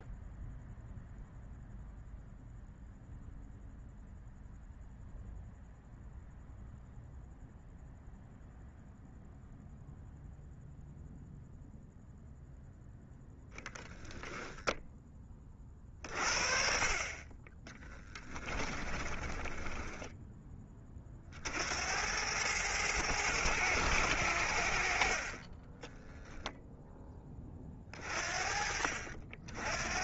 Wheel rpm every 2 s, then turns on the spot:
0, 0, 0, 0, 0, 0, 0, 10, 40, 20, 20, 100, 60, 0, 50.
18-20